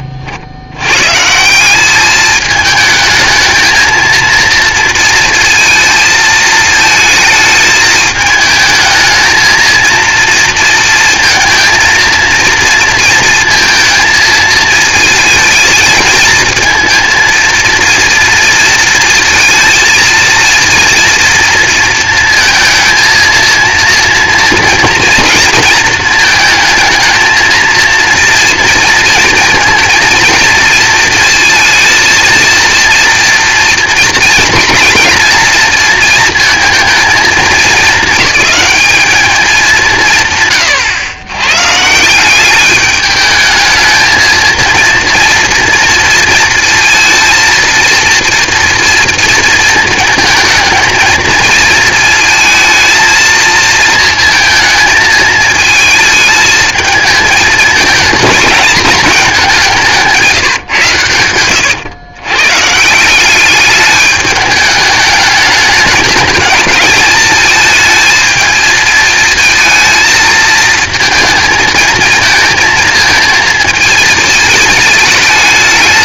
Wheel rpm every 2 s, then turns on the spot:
80, 220, 230, 220, 220, 230, 230, 220, 230, 230, 230, 220, 230, 220, 230, 230, 230, 230, 230, 210, 130, 200, 220, 230, 230, 220, 230, 220, 220, 210, 140, 130, 210, 220, 220, 220, 230, 220.
60-62